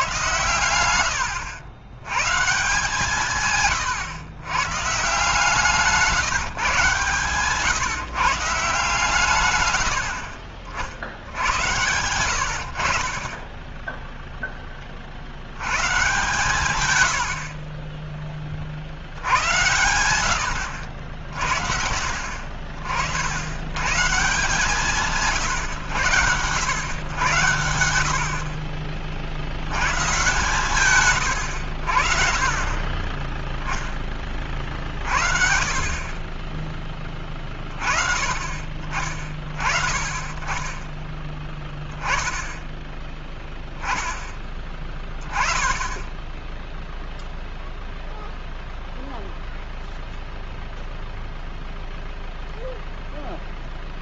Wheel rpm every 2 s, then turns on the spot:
120, 150, 120, 150, 140, 50, 80, 10, 120, 40, 90, 60, 160, 100, 60, 130, 30, 40, 30, 30, 20, 10, 10, 10, 0, 0, 0.
none